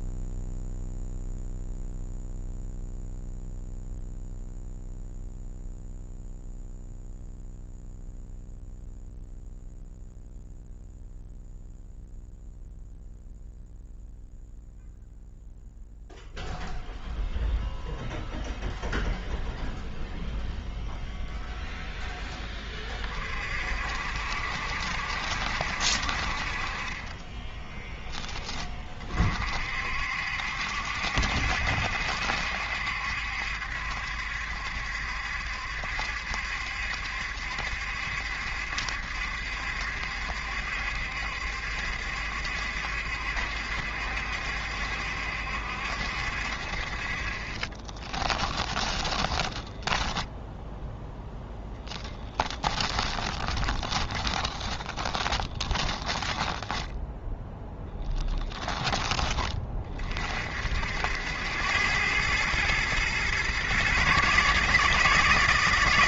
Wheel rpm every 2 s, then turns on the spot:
0, 0, 0, 0, 0, 0, 0, 0, 0, 0, 0, 30, 70, 30, 40, 70, 70, 70, 70, 70, 70, 70, 70, 40, 10, 0, 20, 20, 10, 20, 70, 120, 160.
48-50 52-58